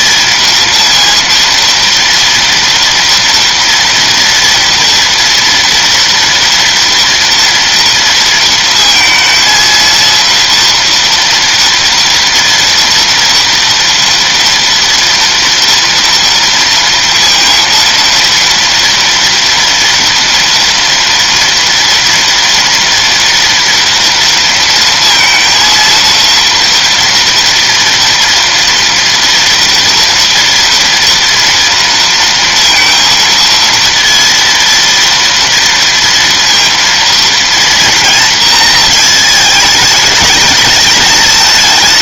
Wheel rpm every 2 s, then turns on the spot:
230, 230, 230, 230, 230, 230, 230, 230, 230, 230, 230, 230, 230, 230, 240, 240, 230, 230, 230, 230, 220.
none